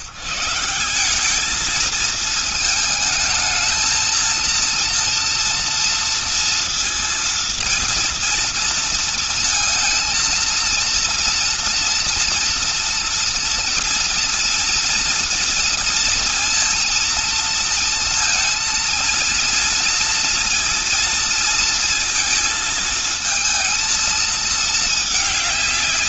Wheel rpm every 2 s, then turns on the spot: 110, 220, 230, 230, 230, 230, 230, 230, 230, 230, 230, 220, 220.
none